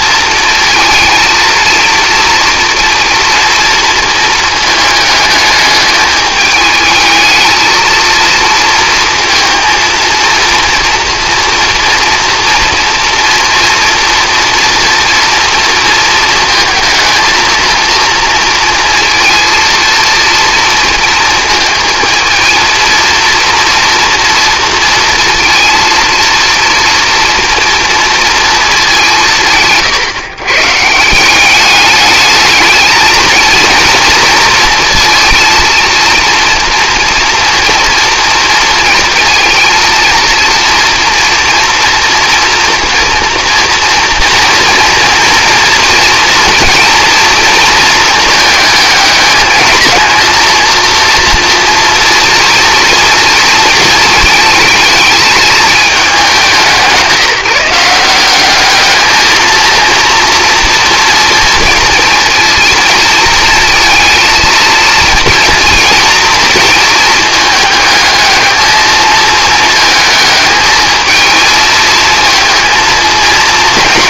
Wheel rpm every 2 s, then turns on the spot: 230, 240, 220, 220, 230, 230, 230, 230, 220, 230, 230, 220, 220, 230, 210, 140, 220, 230, 230, 240, 230, 230, 230, 230, 220, 230, 230, 220, 170, 200, 230, 230, 230, 220, 220, 220, 230.
none